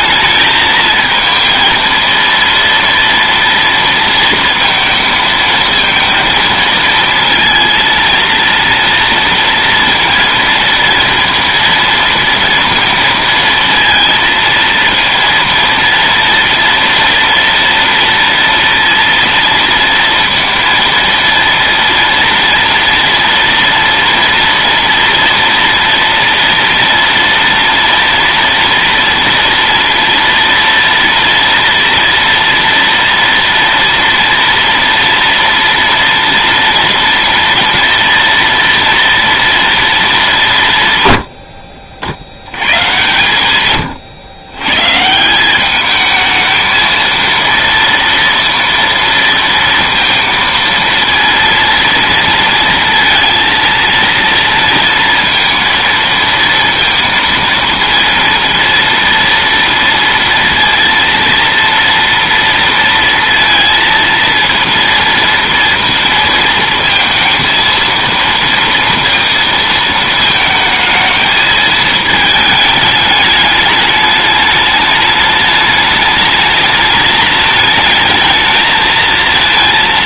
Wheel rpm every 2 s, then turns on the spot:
220, 230, 230, 230, 230, 230, 230, 230, 230, 230, 230, 230, 230, 230, 230, 240, 230, 230, 230, 230, 150, 100, 120, 220, 230, 230, 230, 230, 230, 230, 230, 230, 230, 230, 230, 220, 220, 210, 210, 220.
none